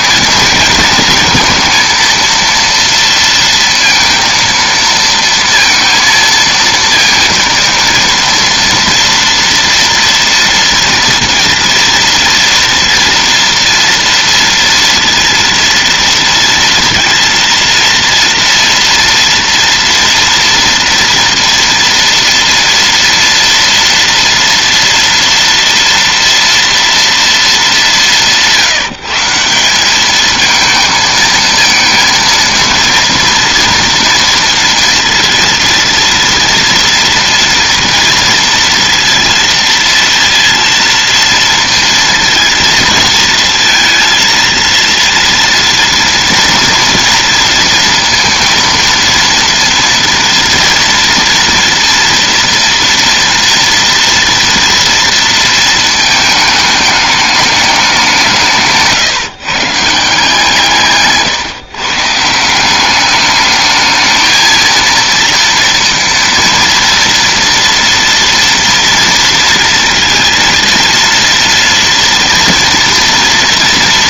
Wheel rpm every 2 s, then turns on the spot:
230, 230, 230, 230, 230, 230, 230, 230, 230, 230, 230, 230, 230, 230, 170, 220, 230, 230, 230, 230, 230, 230, 230, 230, 230, 230, 230, 230, 210, 170, 160, 170, 220, 230, 230, 230, 230.
none